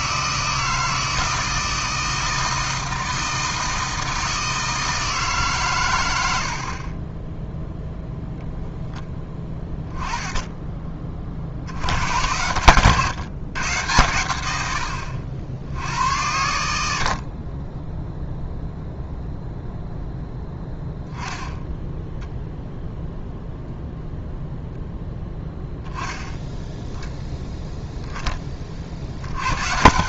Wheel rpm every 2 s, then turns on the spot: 160, 160, 160, 30, 10, 20, 120, 100, 80, 0, 10, 0, 0, 0, 60.
6-8